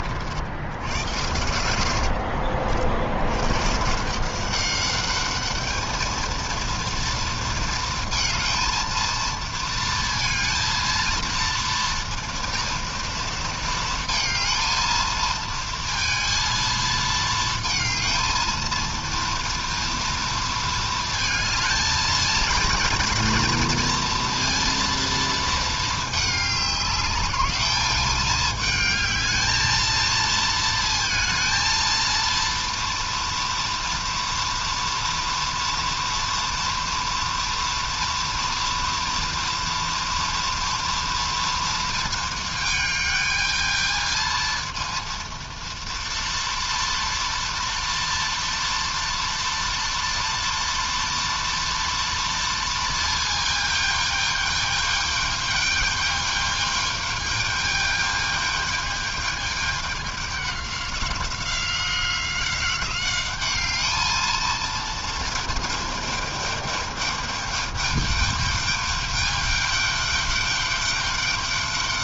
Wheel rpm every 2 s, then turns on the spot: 90, 100, 210, 230, 230, 230, 230, 230, 220, 230, 220, 230, 230, 200, 220, 220, 230, 230, 230, 230, 230, 220, 230, 230, 230, 240, 220, 210, 210, 210, 190, 200, 220, 210, 210, 200.
0-2